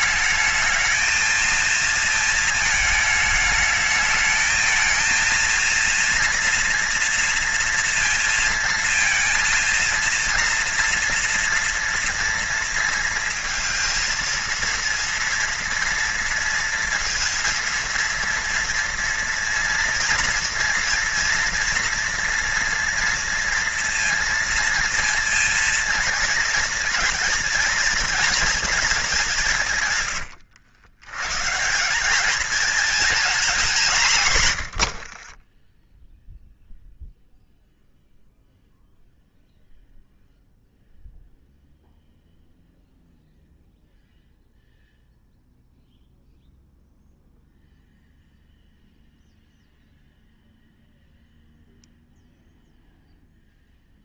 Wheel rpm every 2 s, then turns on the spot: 220, 220, 220, 240, 230, 230, 230, 230, 230, 230, 230, 230, 230, 230, 220, 90, 220, 110, 0, 0, 0, 0, 0, 0, 0, 0, 0.
34-36